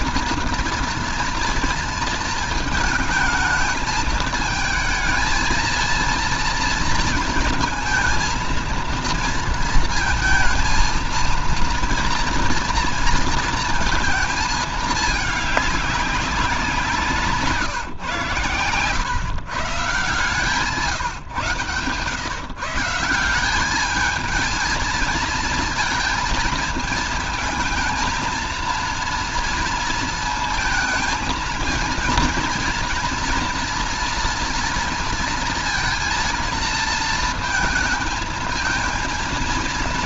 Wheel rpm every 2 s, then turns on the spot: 230, 230, 220, 230, 230, 230, 230, 220, 190, 140, 150, 140, 220, 230, 230, 220, 230, 230, 230, 220.
18-20